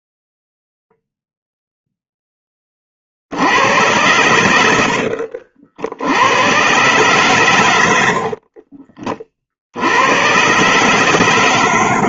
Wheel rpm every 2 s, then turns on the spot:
0, 20, 90, 110, 50, 120.
8-10